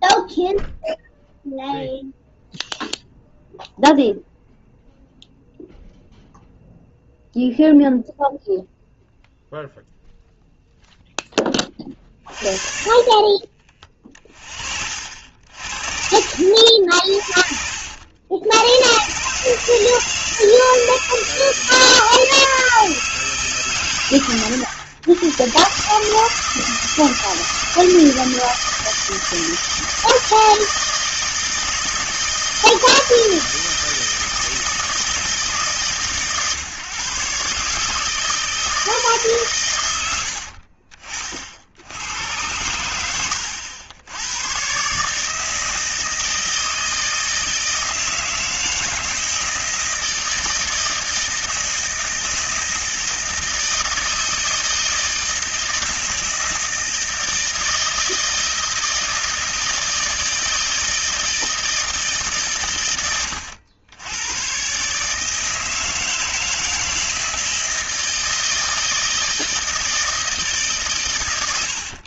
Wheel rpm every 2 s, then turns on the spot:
0, 0, 0, 0, 0, 0, 30, 50, 70, 100, 160, 160, 100, 160, 160, 160, 160, 160, 130, 160, 40, 100, 120, 160, 160, 160, 160, 160, 160, 160, 160, 120, 130, 160, 160, 140.
none